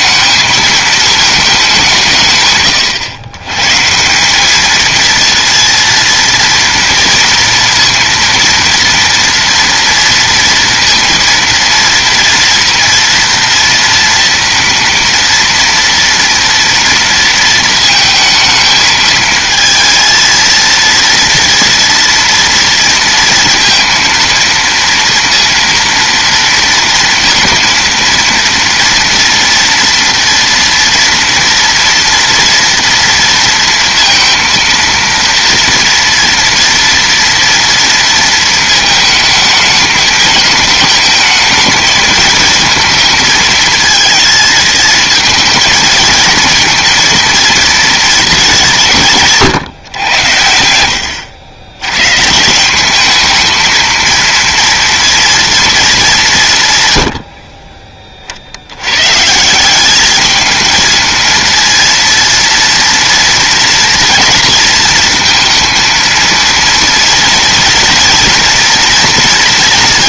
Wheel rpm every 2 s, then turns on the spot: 220, 140, 210, 230, 230, 230, 230, 230, 230, 220, 230, 230, 230, 230, 230, 230, 230, 230, 230, 220, 220, 230, 220, 230, 190, 90, 170, 230, 160, 70, 220, 230, 230, 230, 230.
none